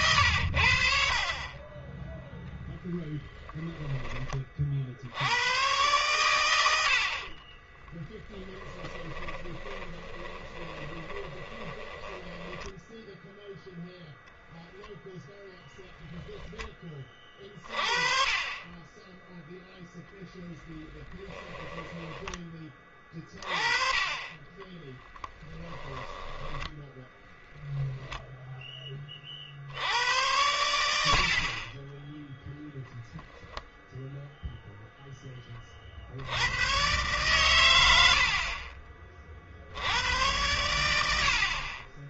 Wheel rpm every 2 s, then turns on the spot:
70, 0, 50, 80, 10, 20, 10, 0, 20, 20, 10, 20, 20, 20, 10, 90, 0, 0, 110, 40, 100.
8-14 24-28